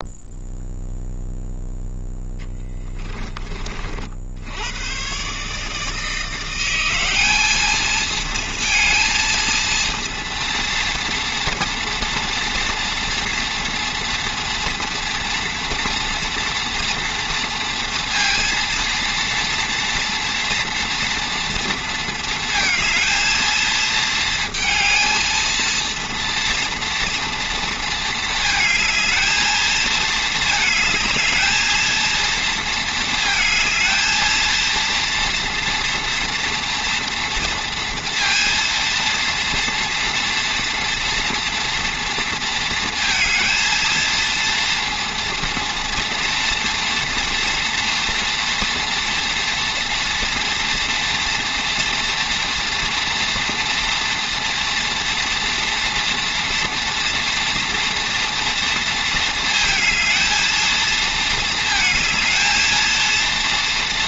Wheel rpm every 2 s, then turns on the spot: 0, 30, 110, 190, 230, 230, 230, 230, 230, 230, 230, 220, 220, 230, 220, 220, 230, 230, 240, 230, 230, 230, 230, 240, 240, 230, 230, 230, 230, 230, 220, 230.
none